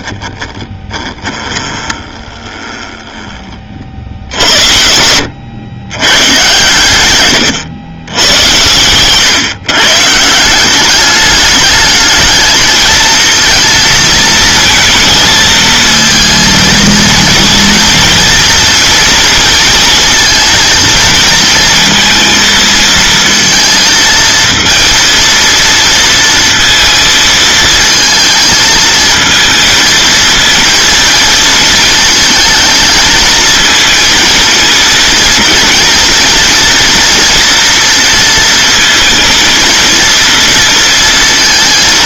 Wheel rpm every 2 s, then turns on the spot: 20, 20, 80, 120, 110, 200, 230, 230, 230, 230, 230, 230, 230, 230, 220, 230, 220, 220, 230, 230, 230.
0-6